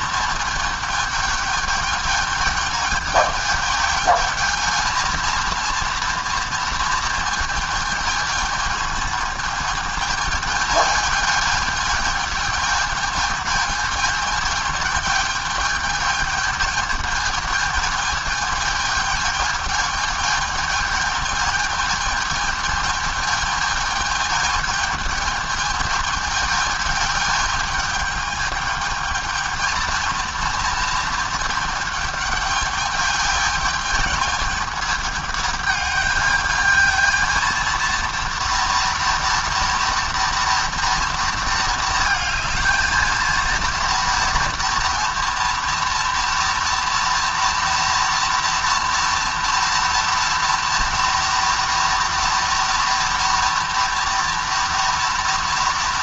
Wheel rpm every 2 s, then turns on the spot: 220, 220, 230, 230, 220, 220, 220, 220, 220, 220, 220, 220, 220, 220, 220, 230, 220, 220, 220, 230, 230, 220, 230, 230, 230, 230, 230, 230.
none